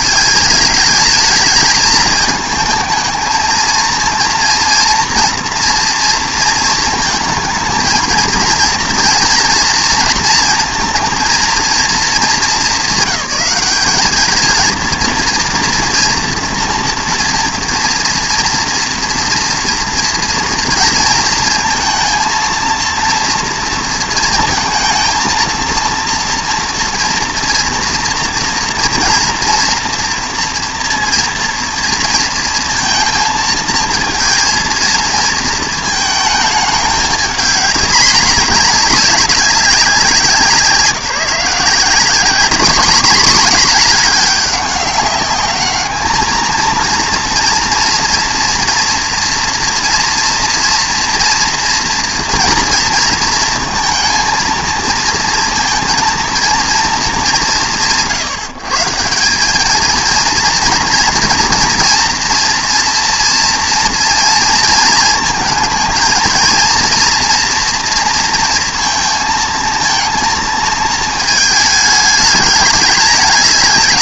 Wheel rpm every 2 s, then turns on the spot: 220, 220, 230, 230, 230, 230, 200, 220, 240, 230, 230, 230, 230, 230, 230, 230, 230, 230, 220, 210, 160, 220, 200, 230, 240, 230, 230, 230, 230, 150, 240, 230, 230, 230, 230, 230, 210.
none